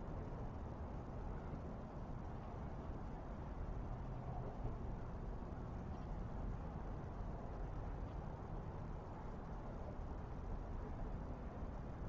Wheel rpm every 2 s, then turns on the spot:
0, 0, 0, 0, 0, 0.
none